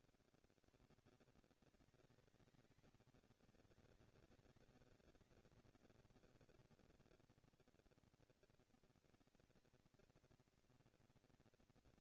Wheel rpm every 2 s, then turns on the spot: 120, 210, 200, 200, 220, 230.
none